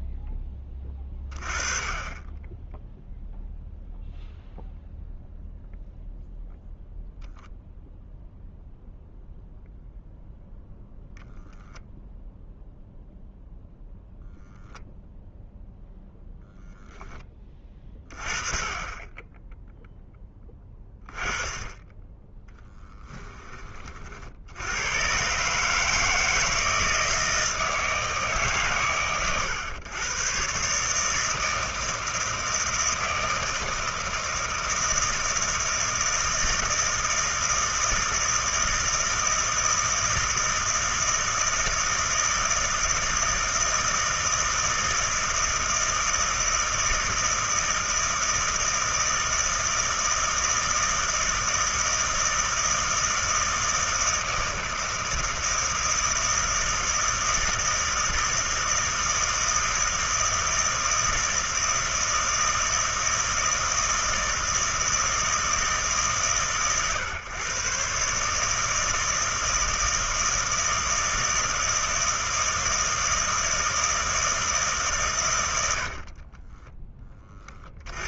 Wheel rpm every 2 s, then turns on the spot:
10, 10, 0, 0, 0, 0, 0, 0, 0, 20, 10, 10, 90, 160, 120, 140, 160, 160, 160, 160, 160, 160, 160, 160, 160, 160, 160, 160, 160, 160, 160, 160, 160, 120, 160, 160, 160, 150, 20.
76-78